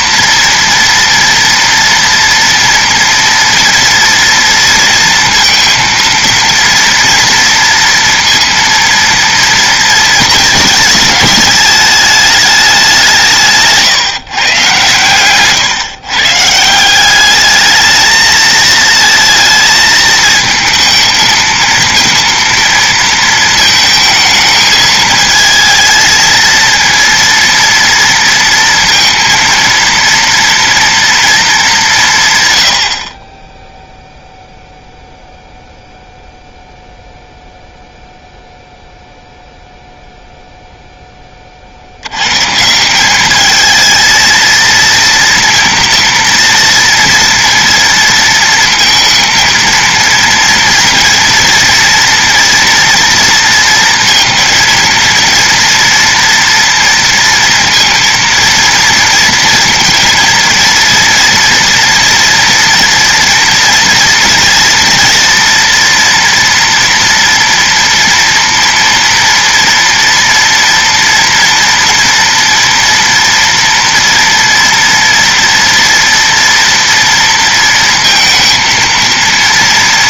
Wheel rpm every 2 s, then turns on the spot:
230, 230, 230, 230, 230, 210, 180, 120, 190, 230, 220, 230, 220, 230, 230, 230, 60, 0, 0, 0, 0, 160, 230, 230, 230, 230, 240, 230, 230, 230, 230, 240, 230, 230, 230, 230, 230, 230, 230, 230.
none